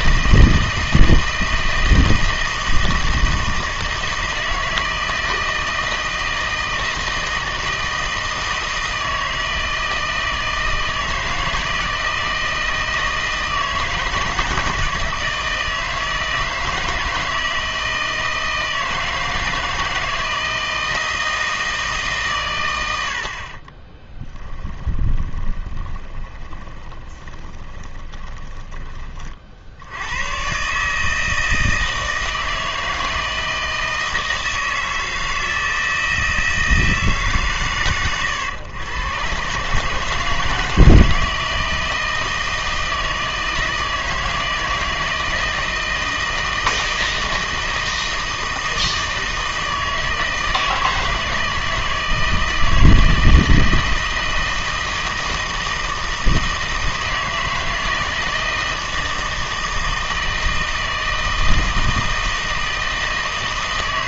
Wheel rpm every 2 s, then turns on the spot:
160, 160, 160, 160, 160, 160, 160, 160, 160, 160, 160, 90, 10, 20, 20, 140, 160, 160, 160, 110, 160, 160, 160, 160, 160, 160, 160, 160, 160, 160, 160, 160.
24-28